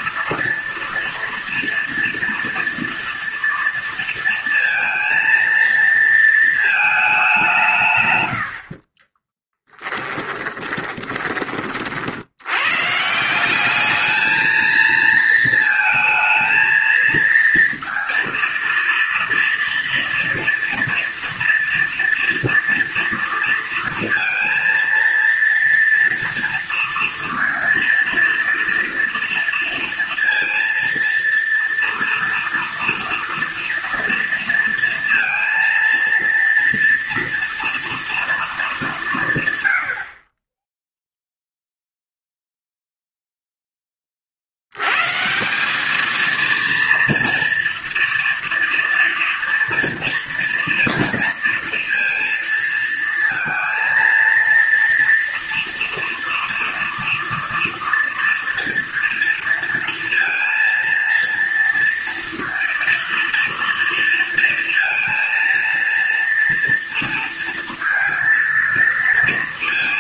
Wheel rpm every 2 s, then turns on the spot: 230, 230, 230, 220, 80, 20, 100, 220, 220, 230, 230, 230, 230, 230, 230, 230, 230, 230, 230, 220, 30, 0, 70, 230, 230, 230, 230, 230, 240, 230, 230, 230, 230, 230, 230.
8-12